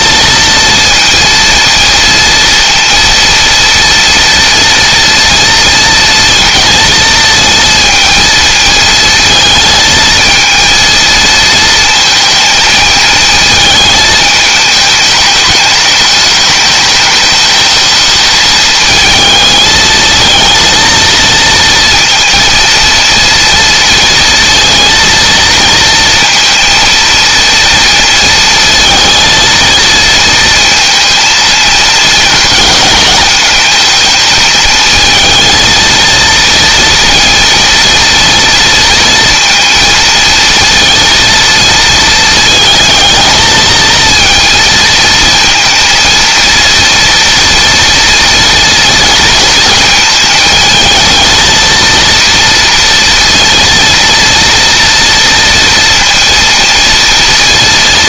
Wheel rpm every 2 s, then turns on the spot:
230, 230, 230, 230, 220, 230, 220, 210, 220, 220, 230, 230, 230, 230, 230, 230, 210, 220, 230, 230, 230, 220, 230, 230, 230, 220, 230, 230, 230.
none